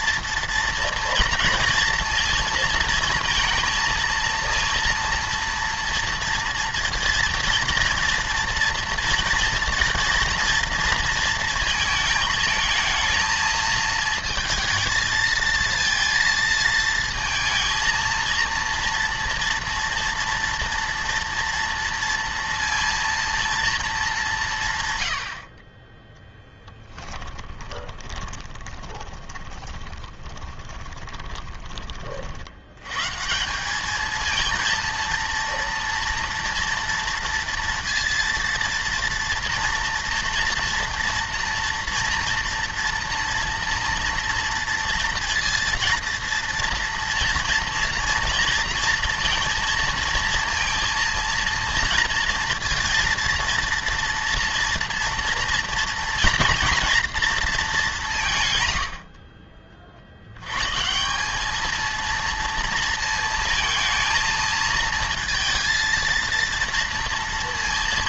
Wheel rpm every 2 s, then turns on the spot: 230, 230, 230, 230, 230, 230, 220, 220, 230, 230, 230, 230, 150, 10, 20, 20, 90, 230, 240, 230, 230, 230, 230, 230, 230, 230, 230, 230, 230, 110, 130, 230, 230, 230.
26-32